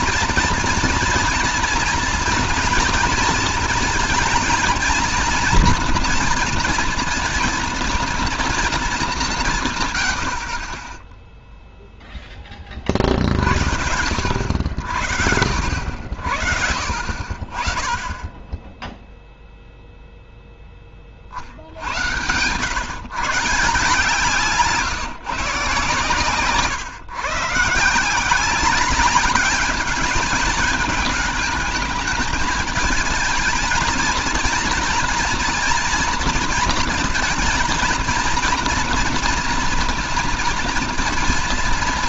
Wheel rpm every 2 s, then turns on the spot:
230, 240, 230, 230, 220, 30, 30, 80, 60, 0, 10, 120, 150, 130, 190, 220, 220, 230, 230, 230, 230.
none